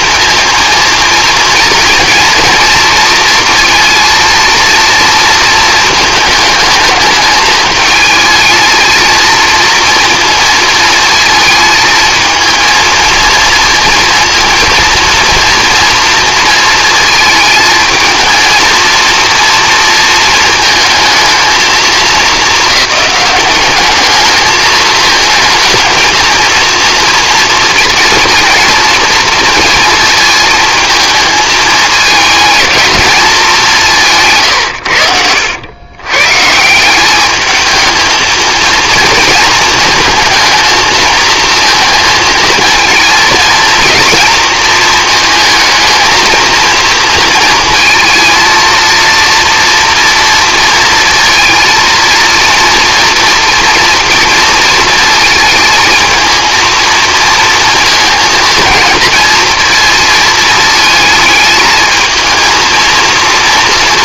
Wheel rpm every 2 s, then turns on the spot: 230, 230, 230, 220, 220, 230, 230, 230, 230, 220, 220, 200, 220, 230, 230, 220, 220, 130, 160, 230, 220, 220, 220, 230, 230, 230, 230, 230, 230, 220, 220, 230.
none